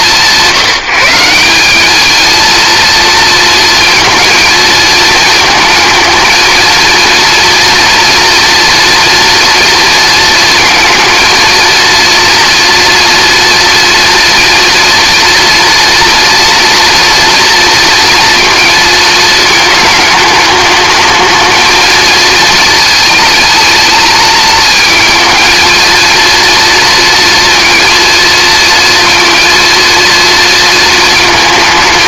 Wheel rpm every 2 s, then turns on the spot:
170, 230, 220, 230, 230, 230, 230, 230, 240, 230, 210, 220, 220, 230, 230, 220.
none